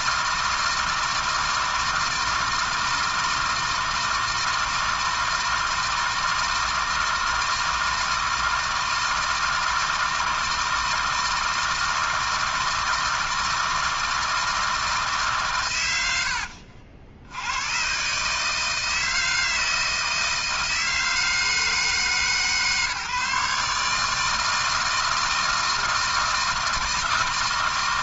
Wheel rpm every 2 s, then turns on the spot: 160, 160, 160, 160, 160, 160, 160, 160, 80, 160, 160, 150, 160, 160.
none